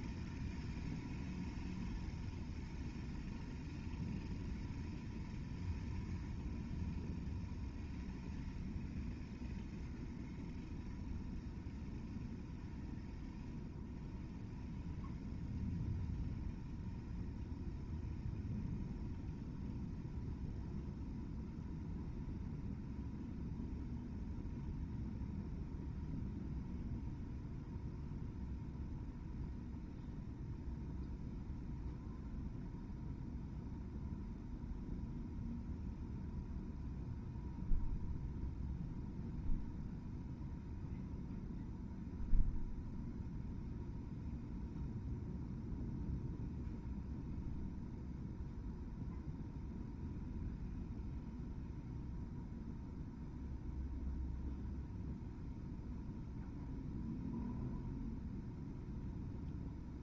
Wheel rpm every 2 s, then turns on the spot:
0, 0, 0, 0, 0, 0, 0, 0, 0, 0, 0, 0, 0, 0, 0, 0, 0, 0, 0, 0, 0, 0, 0, 0, 0, 0, 0, 0, 0, 0.
none